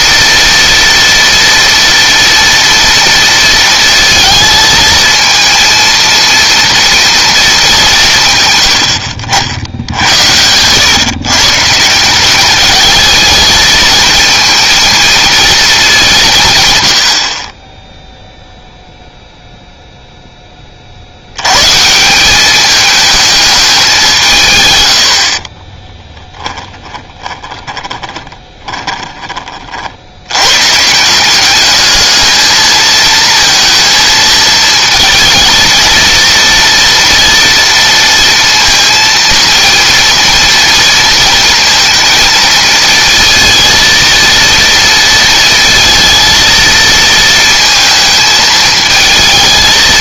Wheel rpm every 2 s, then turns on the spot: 230, 230, 220, 230, 90, 130, 210, 230, 100, 0, 40, 210, 100, 20, 20, 150, 220, 230, 230, 230, 230, 220, 230, 230, 220.
26-30